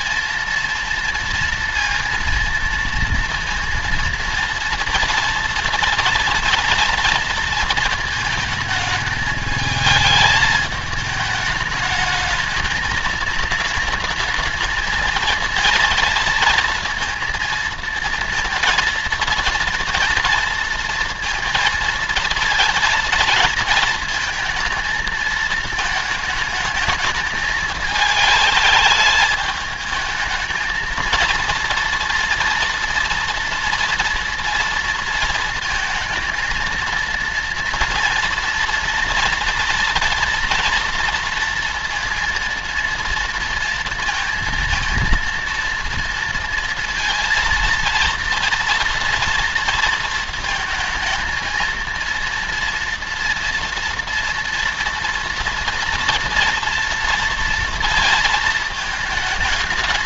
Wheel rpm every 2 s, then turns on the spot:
230, 230, 230, 230, 230, 220, 210, 220, 230, 230, 230, 230, 230, 210, 220, 220, 230, 230, 220, 230, 230, 230, 230, 230, 230, 230, 230, 230, 240, 230.
none